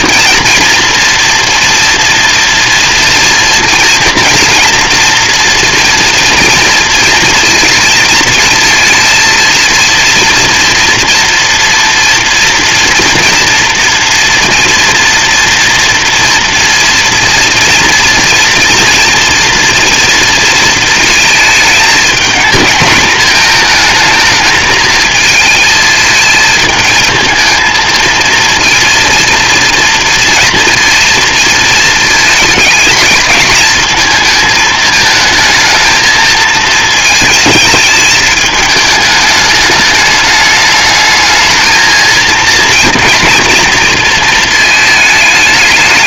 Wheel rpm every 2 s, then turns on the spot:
230, 230, 230, 230, 230, 230, 230, 230, 240, 230, 220, 230, 220, 220, 230, 230, 220, 220, 230, 210, 210, 230, 220.
none